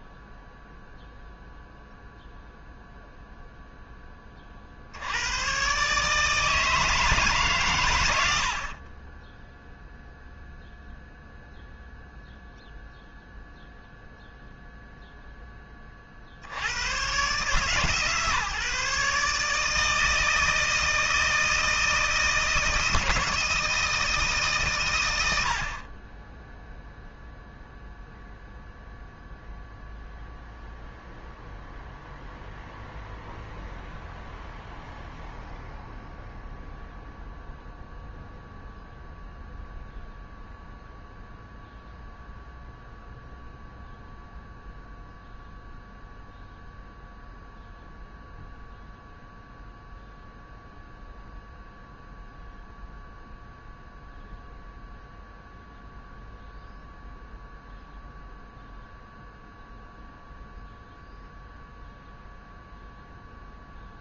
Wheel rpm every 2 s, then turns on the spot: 0, 0, 60, 160, 40, 0, 0, 0, 100, 150, 160, 170, 130, 0, 0, 0, 0, 0, 0, 0, 0, 0, 0, 0, 0, 0, 0, 0, 0, 0, 0, 0.
none